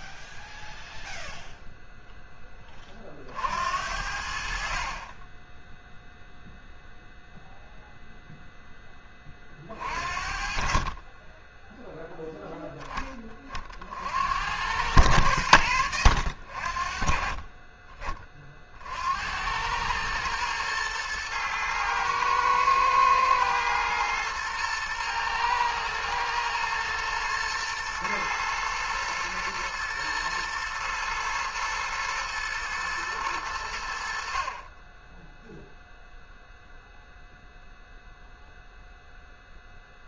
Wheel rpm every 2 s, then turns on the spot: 0, 20, 50, 0, 10, 40, 10, 100, 50, 40, 110, 110, 110, 120, 110, 120, 120, 30, 0, 0.
none